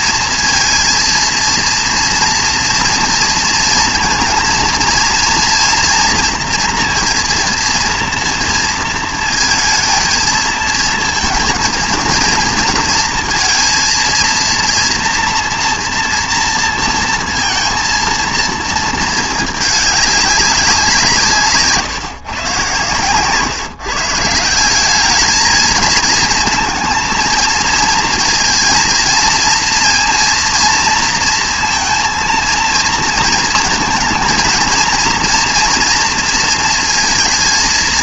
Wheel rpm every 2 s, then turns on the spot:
230, 230, 230, 230, 230, 220, 230, 230, 230, 230, 190, 130, 170, 220, 230, 230, 230, 230, 230.
none